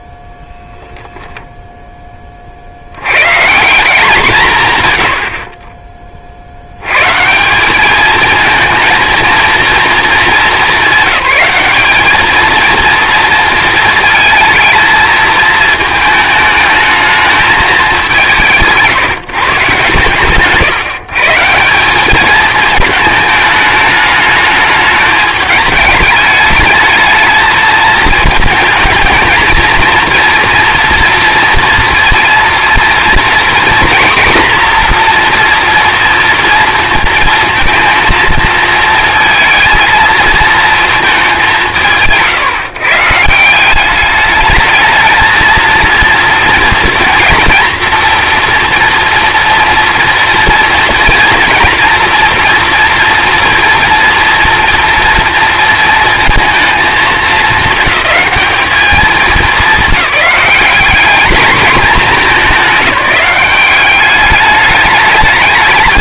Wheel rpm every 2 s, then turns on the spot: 0, 60, 120, 80, 230, 210, 230, 220, 220, 170, 140, 220, 210, 210, 220, 230, 240, 240, 230, 230, 230, 140, 220, 230, 240, 230, 230, 230, 220, 200, 200, 190, 210.
none